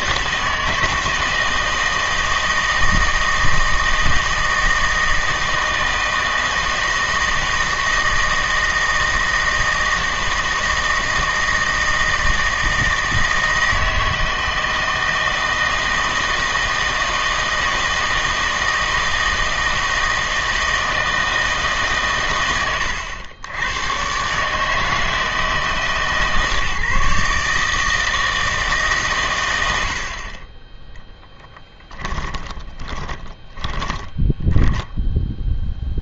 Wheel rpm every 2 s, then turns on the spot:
160, 160, 160, 160, 160, 160, 160, 160, 160, 160, 160, 100, 160, 150, 150, 10, 20, 10.
32-36